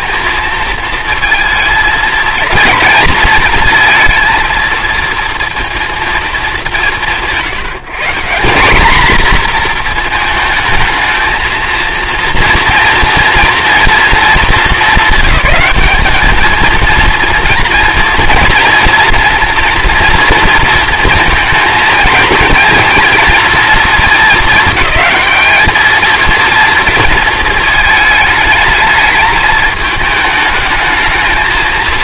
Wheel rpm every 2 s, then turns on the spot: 220, 220, 230, 200, 210, 220, 230, 200, 220, 230, 230, 220, 220, 230, 210, 220.
none